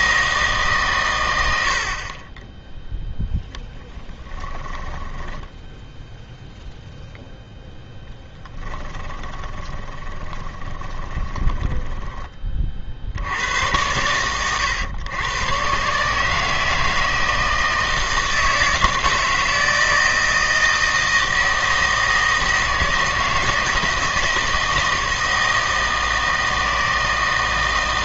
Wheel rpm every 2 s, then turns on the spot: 150, 10, 10, 0, 10, 20, 40, 110, 160, 160, 160, 160, 160, 160.
4-6 8-12